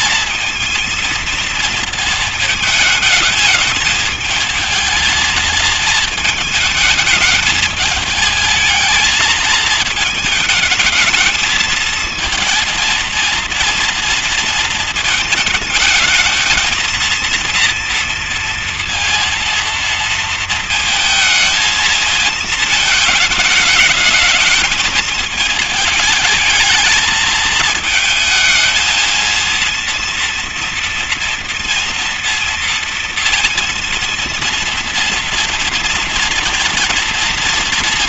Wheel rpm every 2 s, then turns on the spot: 220, 220, 220, 220, 220, 220, 230, 230, 220, 230, 230, 220, 210, 220, 230, 230, 230, 230, 230.
none